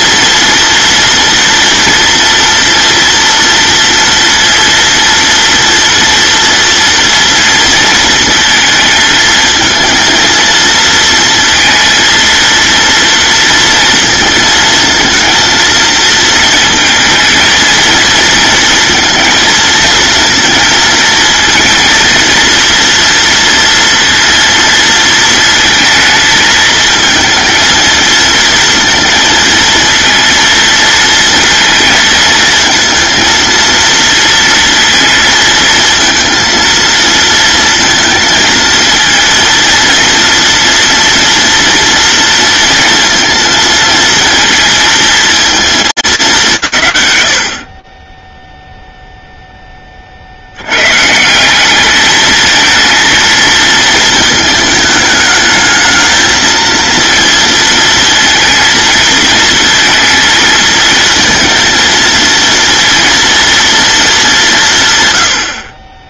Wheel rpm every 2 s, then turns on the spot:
230, 230, 230, 240, 220, 230, 230, 220, 220, 220, 230, 240, 230, 220, 230, 230, 230, 230, 230, 230, 230, 230, 230, 110, 0, 150, 230, 220, 230, 220, 230, 230, 110.
none